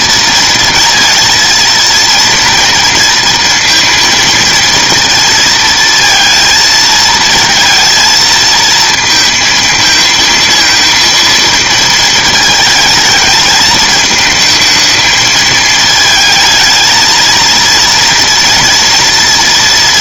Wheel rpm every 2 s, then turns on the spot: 230, 230, 230, 220, 220, 230, 210, 220, 220, 230.
none